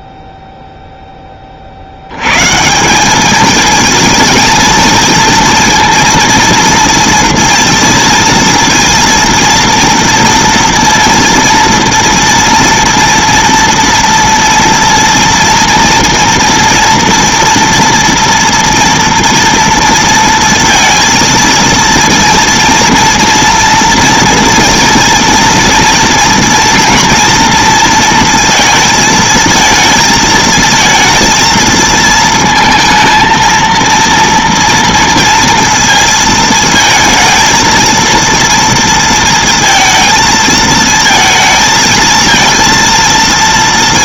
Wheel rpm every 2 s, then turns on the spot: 0, 170, 230, 230, 230, 230, 230, 230, 230, 230, 230, 230, 230, 230, 230, 220, 220, 230, 220, 230, 220, 230.
none